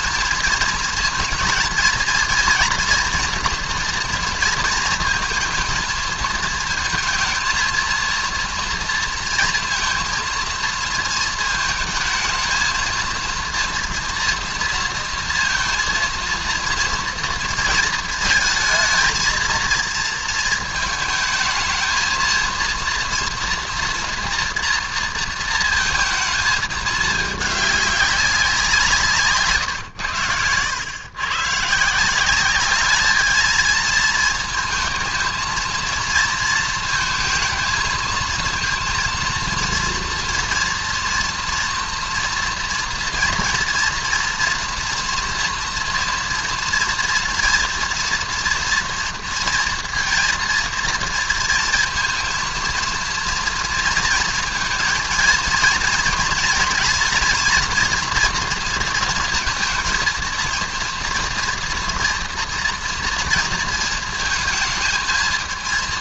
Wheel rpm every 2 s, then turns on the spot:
230, 230, 230, 220, 230, 230, 230, 230, 230, 220, 220, 230, 230, 210, 170, 110, 210, 220, 230, 230, 230, 230, 230, 230, 230, 230, 230, 230, 240, 230, 230, 230, 230.
none